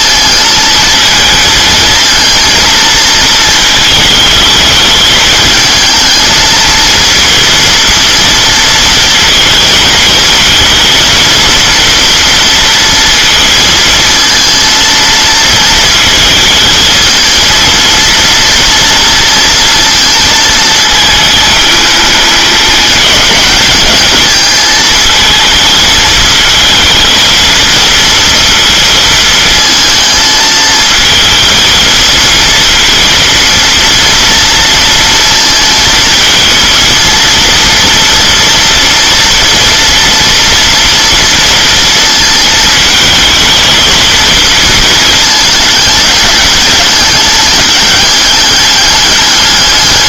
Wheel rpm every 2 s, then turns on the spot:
220, 230, 220, 230, 230, 230, 230, 230, 230, 230, 220, 210, 220, 220, 230, 220, 230, 230, 230, 230, 230, 220, 230, 210, 210.
none